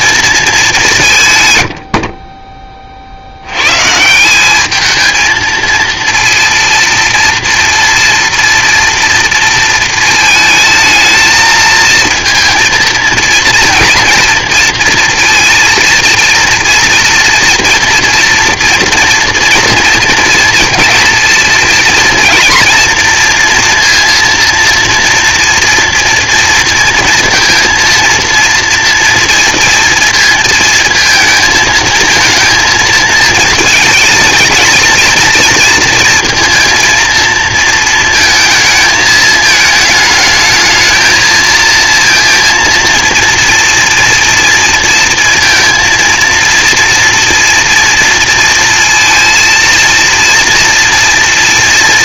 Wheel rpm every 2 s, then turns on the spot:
210, 30, 210, 240, 230, 220, 230, 230, 230, 230, 230, 230, 240, 230, 230, 230, 230, 220, 230, 220, 220, 230, 230, 230, 230, 230.
none